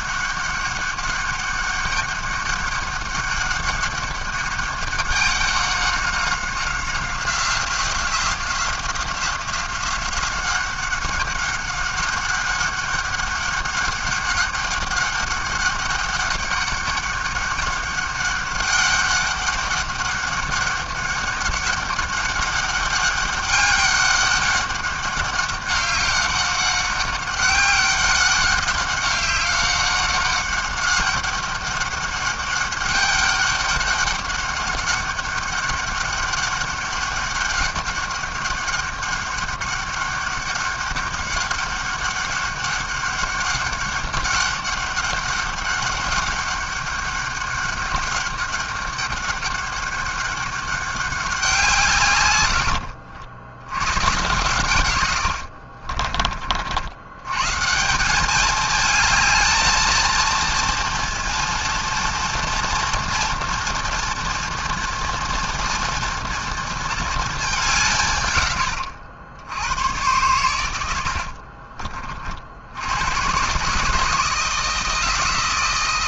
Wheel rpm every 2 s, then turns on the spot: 200, 200, 200, 180, 180, 200, 200, 200, 200, 200, 200, 200, 200, 200, 200, 200, 200, 200, 200, 200, 200, 200, 200, 200, 200, 190, 80, 90, 120, 220, 230, 230, 230, 220, 80, 60, 120, 160.
54-56 70-72